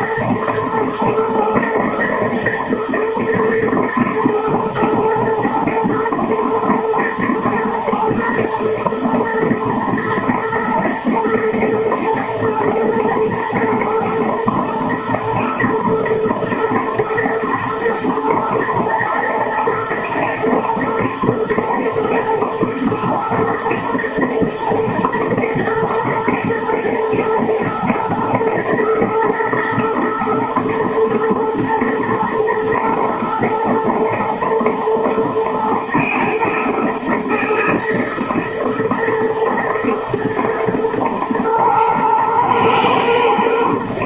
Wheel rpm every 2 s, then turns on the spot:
110, 110, 110, 110, 110, 110, 110, 120, 120, 120, 120, 110, 120, 110, 110, 120, 120, 120, 110, 120, 120, 110.
none